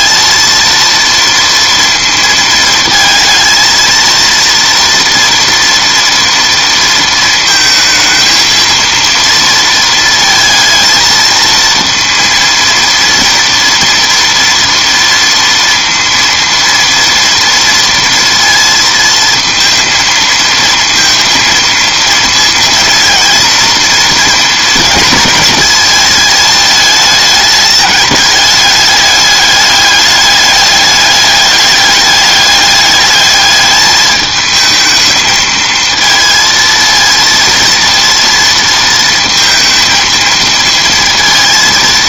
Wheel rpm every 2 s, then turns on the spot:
230, 230, 230, 230, 230, 230, 230, 230, 230, 230, 230, 230, 220, 220, 210, 210, 210, 220, 230, 230, 230.
none